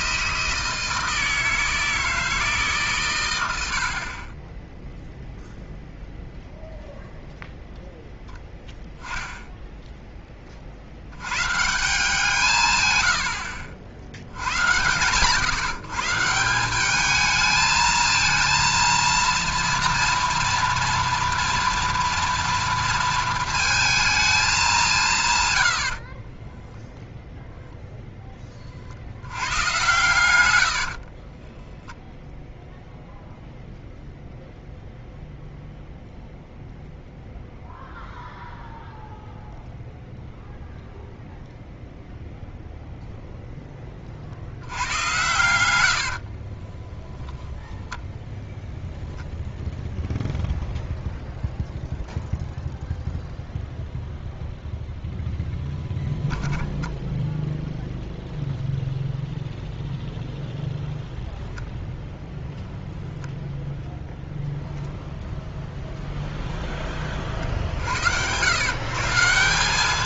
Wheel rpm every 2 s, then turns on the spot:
160, 160, 10, 0, 10, 30, 140, 100, 180, 230, 230, 230, 210, 10, 30, 80, 0, 0, 0, 0, 0, 0, 70, 40, 0, 0, 0, 0, 10, 0, 0, 0, 0, 0, 110.
26-28 30-32 46-48